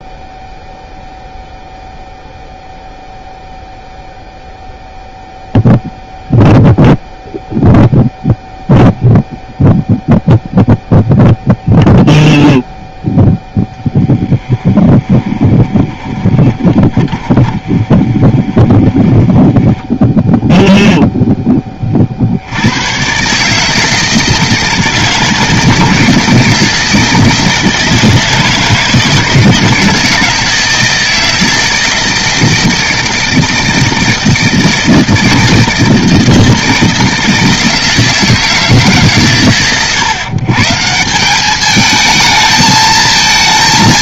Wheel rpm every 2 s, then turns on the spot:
0, 0, 0, 0, 0, 0, 0, 10, 20, 20, 0, 120, 160, 160, 160, 160, 160, 160, 160, 130, 170, 210.
14-20